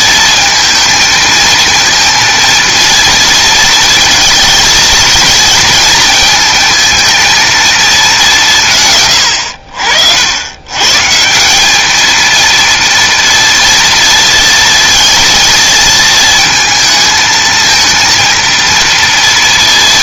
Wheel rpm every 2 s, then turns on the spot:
220, 230, 230, 220, 150, 120, 240, 230, 220, 230.
none